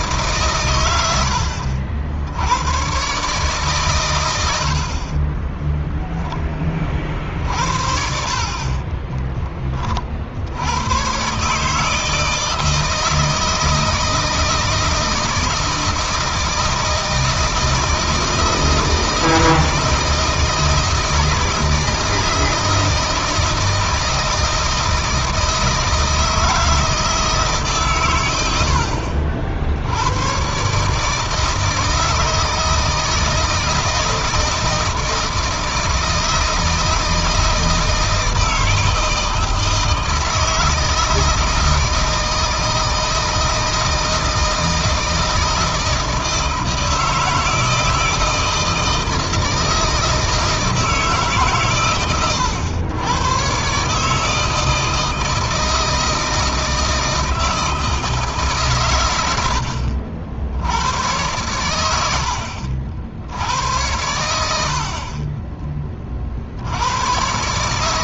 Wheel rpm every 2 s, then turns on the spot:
120, 100, 70, 30, 50, 80, 160, 160, 160, 160, 160, 160, 160, 160, 70, 140, 160, 160, 160, 160, 160, 160, 160, 160, 160, 160, 100, 160, 160, 140, 90, 60, 70, 80.
8-10